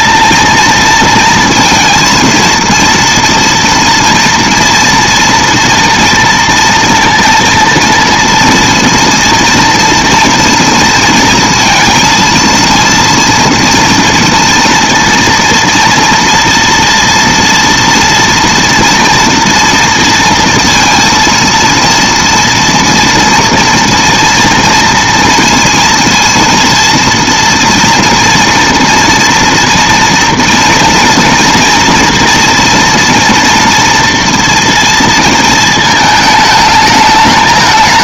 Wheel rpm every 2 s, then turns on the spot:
230, 230, 230, 230, 230, 230, 230, 230, 230, 230, 230, 230, 240, 230, 230, 230, 230, 230, 210.
none